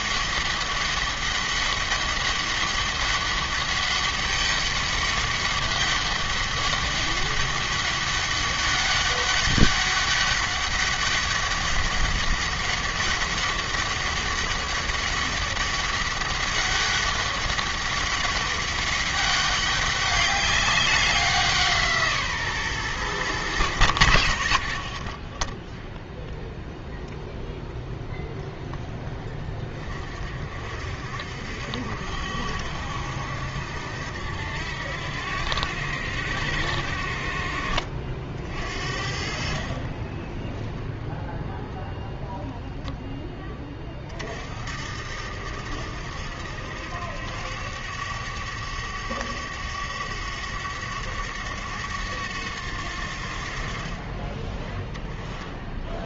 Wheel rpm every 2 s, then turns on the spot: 200, 190, 200, 200, 200, 200, 200, 200, 200, 200, 200, 140, 80, 0, 0, 50, 80, 80, 80, 50, 0, 0, 60, 80, 100, 100, 90, 20.
none